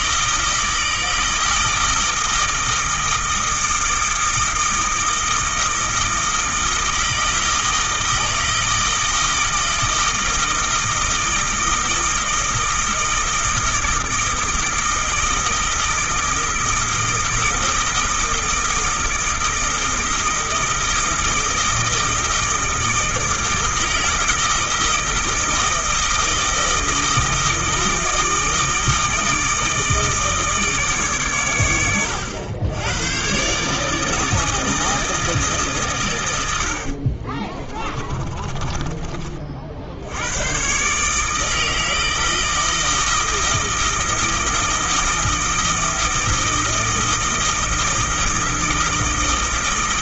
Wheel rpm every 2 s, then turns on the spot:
160, 160, 160, 160, 160, 160, 160, 160, 160, 160, 160, 160, 160, 160, 160, 150, 100, 160, 70, 30, 130, 160, 160, 160, 160.
36-40